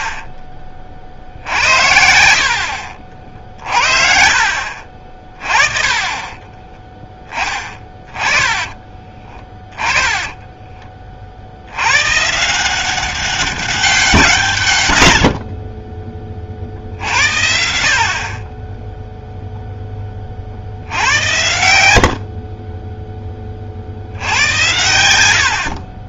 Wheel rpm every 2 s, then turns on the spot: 40, 60, 50, 20, 20, 20, 150, 150, 50, 30, 40, 60, 90.
6-8